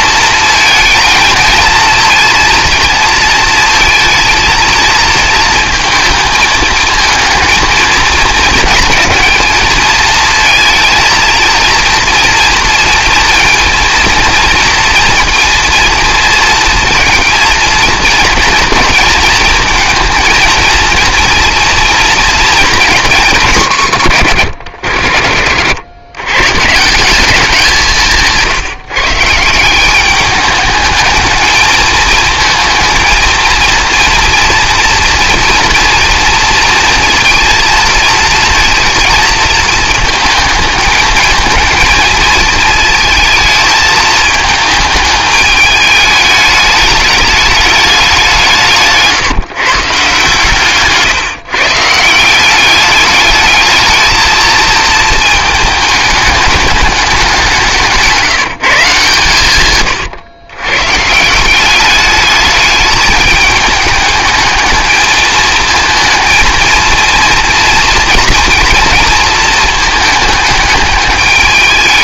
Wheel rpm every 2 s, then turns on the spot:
220, 230, 230, 220, 220, 230, 230, 230, 230, 230, 230, 220, 100, 170, 150, 210, 230, 240, 230, 230, 220, 220, 220, 210, 160, 150, 200, 220, 210, 150, 120, 210, 220, 230, 230, 210.
50-52